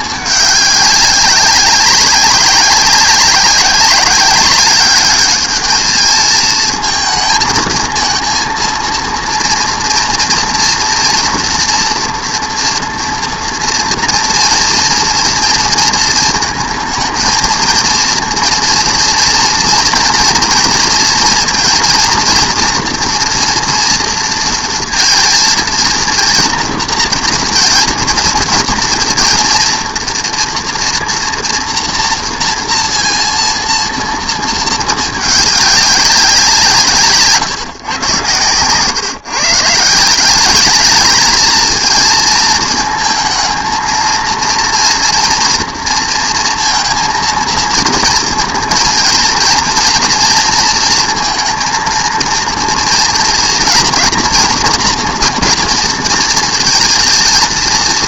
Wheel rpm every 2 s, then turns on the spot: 200, 190, 200, 230, 230, 230, 230, 230, 230, 230, 230, 240, 230, 230, 230, 240, 230, 220, 170, 120, 210, 230, 230, 230, 230, 230, 230, 240, 230.
38-40